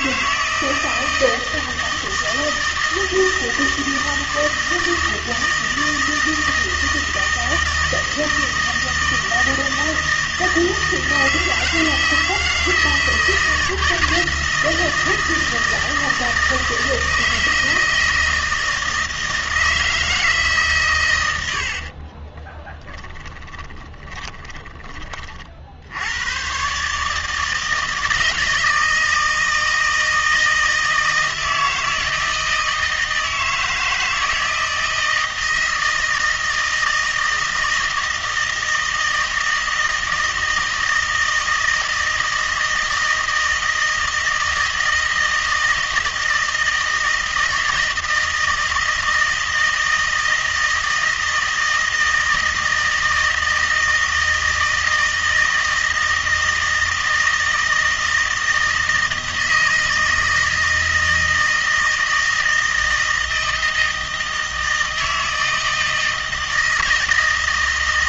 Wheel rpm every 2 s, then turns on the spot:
160, 160, 160, 160, 160, 160, 160, 160, 160, 160, 140, 10, 10, 130, 160, 160, 160, 160, 160, 160, 160, 160, 160, 160, 160, 160, 160, 160, 160, 160, 160, 160, 160, 160.
22-26